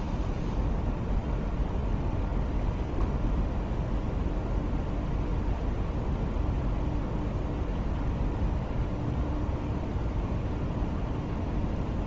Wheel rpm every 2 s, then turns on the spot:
0, 0, 0, 0, 0, 0.
none